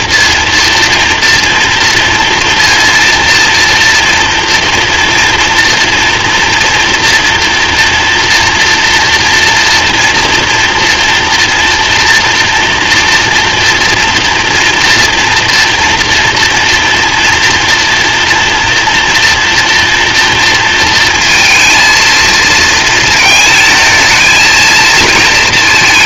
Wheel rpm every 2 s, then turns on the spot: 240, 230, 230, 230, 240, 230, 230, 240, 230, 240, 230, 230, 230.
none